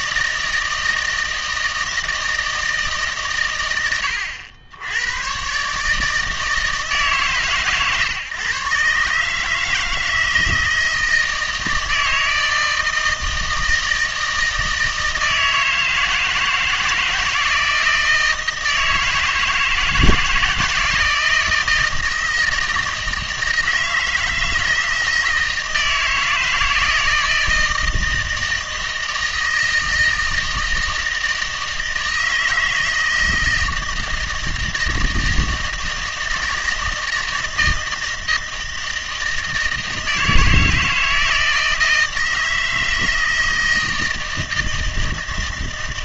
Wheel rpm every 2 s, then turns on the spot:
160, 160, 90, 150, 130, 160, 160, 160, 160, 160, 170, 160, 160, 160, 160, 160, 160, 160, 160, 160, 160, 160, 160.
none